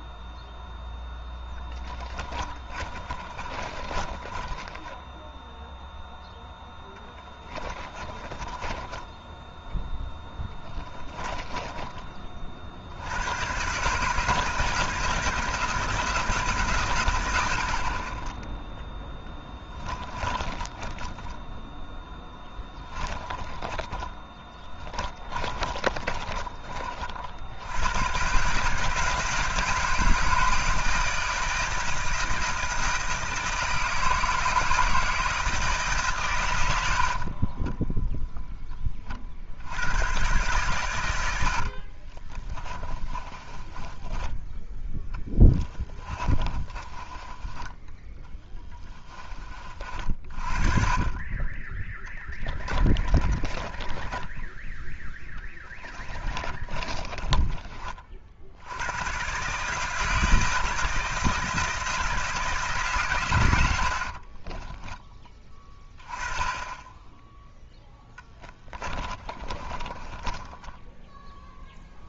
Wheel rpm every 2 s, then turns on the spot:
0, 30, 20, 10, 20, 10, 60, 160, 140, 10, 20, 10, 10, 40, 150, 160, 160, 160, 80, 10, 120, 20, 10, 30, 30, 30, 20, 10, 30, 80, 160, 160, 30, 10, 10, 10.
2-6 8-12 20-26 42-50 52-54 56-58 64-66 68-72